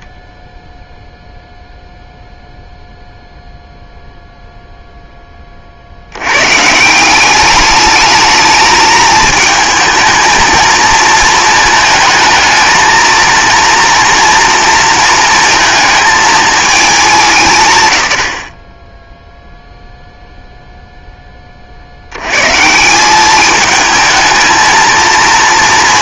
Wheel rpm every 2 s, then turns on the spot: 0, 0, 0, 150, 220, 220, 220, 230, 220, 30, 0, 150, 220.
none